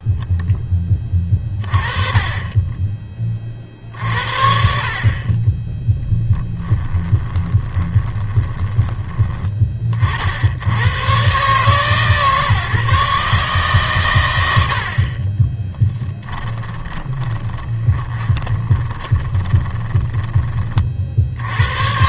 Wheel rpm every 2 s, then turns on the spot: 10, 20, 50, 10, 20, 80, 140, 80, 20, 20, 30.
6-10 14-20